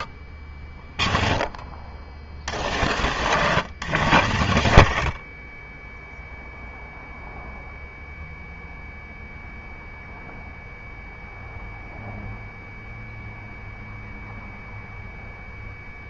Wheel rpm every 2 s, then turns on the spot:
30, 80, 60, 0, 0, 0, 0, 0.
4-6